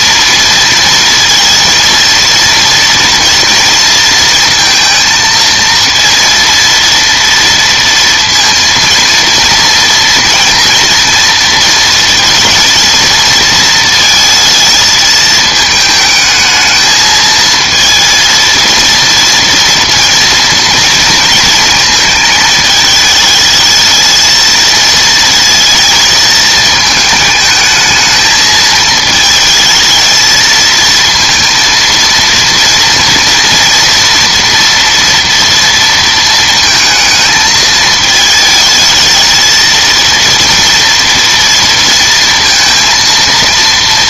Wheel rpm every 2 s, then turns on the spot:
230, 230, 230, 230, 230, 230, 230, 220, 220, 230, 230, 220, 230, 220, 220, 230, 230, 240, 220, 220, 230, 230.
none